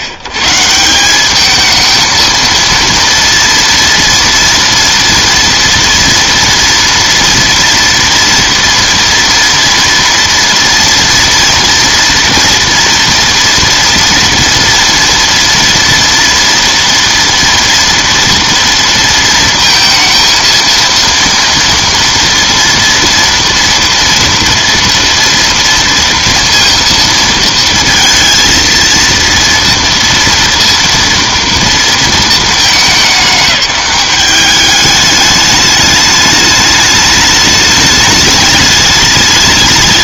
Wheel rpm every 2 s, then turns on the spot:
110, 230, 230, 230, 230, 230, 240, 230, 230, 230, 230, 240, 230, 230, 230, 230, 210, 200, 210, 210.
none